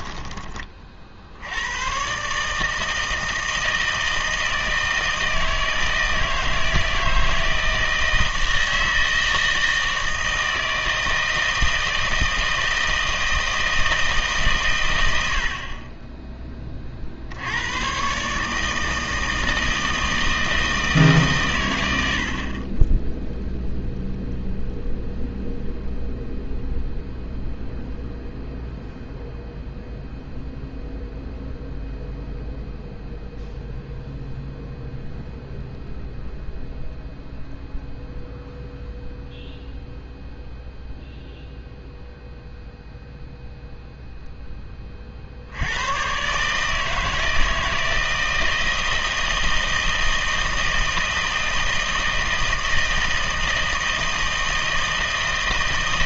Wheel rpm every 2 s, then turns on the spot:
30, 150, 160, 160, 160, 160, 160, 130, 20, 150, 160, 30, 0, 0, 0, 0, 0, 0, 0, 0, 0, 0, 20, 150, 160, 160, 160, 160.
none